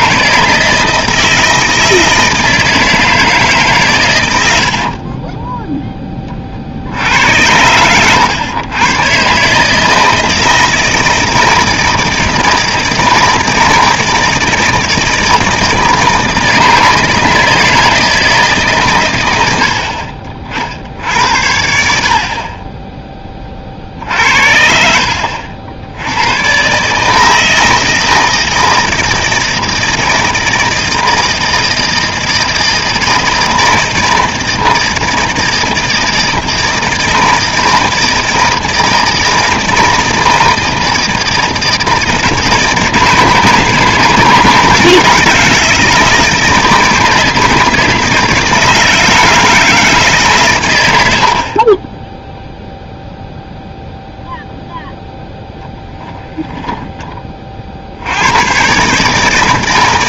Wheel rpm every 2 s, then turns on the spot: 160, 160, 80, 50, 110, 160, 160, 160, 160, 150, 50, 20, 60, 120, 160, 160, 160, 160, 160, 160, 160, 160, 160, 160, 160, 110, 0, 0, 10, 130.
4-6 56-58